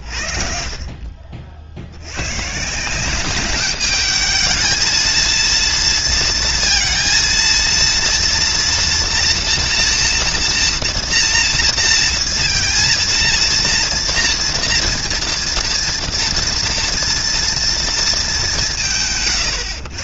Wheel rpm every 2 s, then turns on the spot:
10, 60, 210, 230, 230, 230, 230, 230, 230, 230.
none